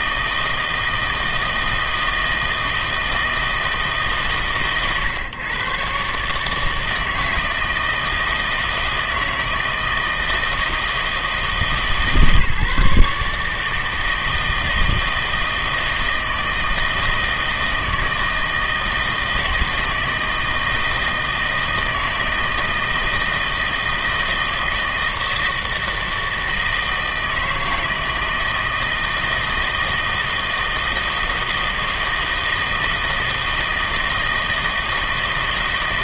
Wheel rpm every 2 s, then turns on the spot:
160, 160, 130, 150, 160, 160, 150, 160, 160, 160, 160, 160, 160, 160, 160, 160, 160, 160.
none